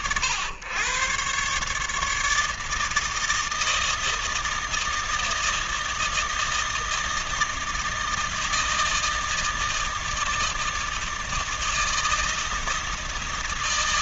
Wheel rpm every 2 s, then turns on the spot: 110, 160, 160, 160, 160, 160, 160.
none